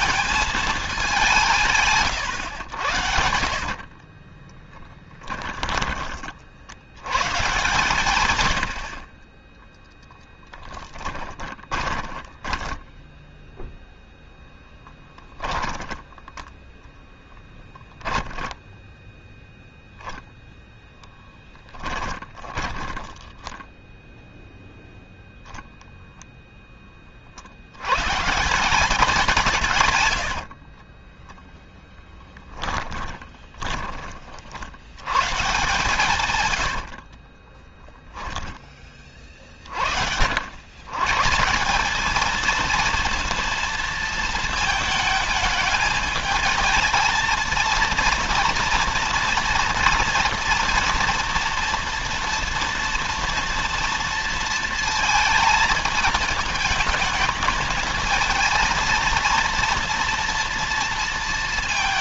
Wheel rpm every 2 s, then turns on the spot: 200, 70, 20, 110, 60, 10, 10, 10, 10, 10, 0, 20, 0, 20, 170, 30, 10, 100, 60, 20, 120, 230, 220, 220, 240, 230, 230, 230, 220, 230, 230.
2-6 10-14 16-20 22-24 30-34 36-38